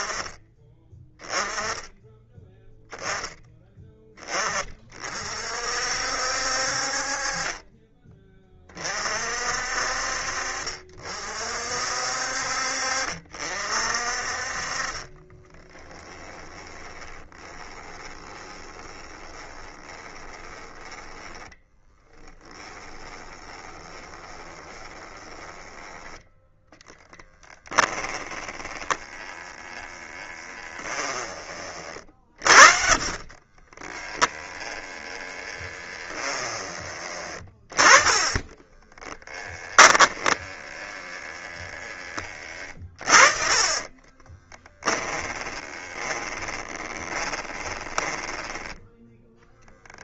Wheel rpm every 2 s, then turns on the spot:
10, 10, 40, 40, 40, 50, 50, 30, 20, 20, 20, 20, 20, 10, 10, 20, 50, 20, 20, 10, 10, 40, 10, 20, 10.
14-36 38-40 42-50